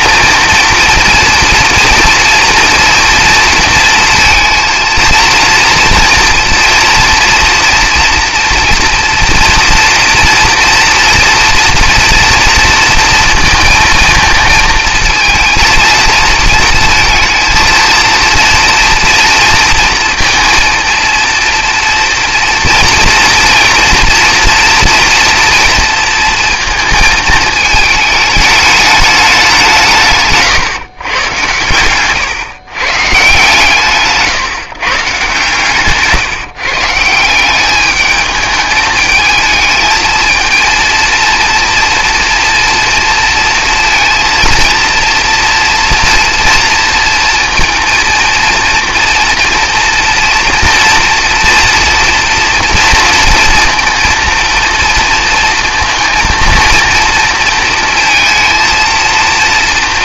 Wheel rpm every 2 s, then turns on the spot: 230, 240, 230, 230, 230, 240, 230, 230, 230, 230, 230, 230, 230, 230, 210, 140, 130, 150, 150, 210, 230, 240, 230, 230, 230, 240, 230, 230, 230, 230.
none